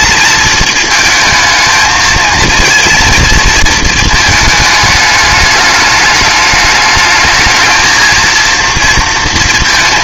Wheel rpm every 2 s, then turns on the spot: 220, 230, 210, 210, 230.
none